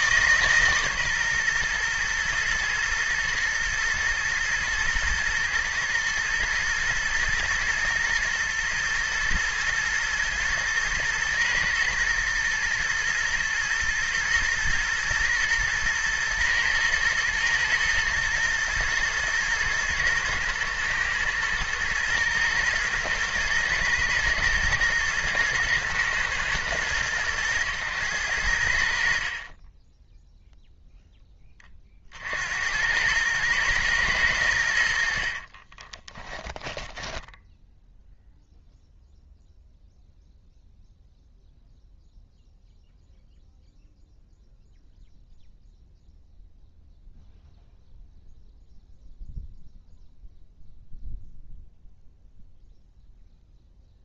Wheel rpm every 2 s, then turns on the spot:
140, 110, 110, 110, 110, 120, 120, 120, 120, 110, 110, 120, 110, 110, 70, 0, 90, 80, 10, 0, 0, 0, 0, 0, 0, 0, 0.
34-36